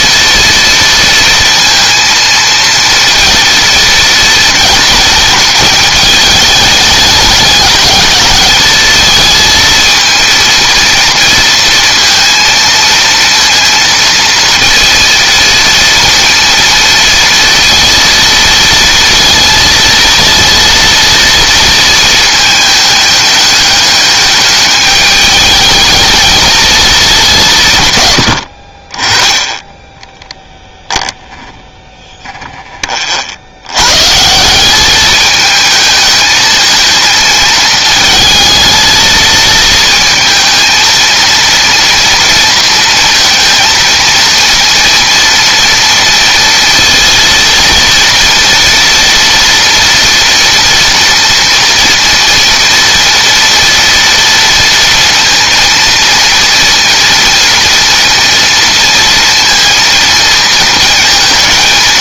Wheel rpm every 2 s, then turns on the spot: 230, 230, 230, 210, 220, 230, 230, 230, 230, 230, 230, 210, 210, 210, 40, 0, 30, 200, 220, 220, 230, 230, 230, 230, 230, 230, 240, 230, 230, 230, 230.
none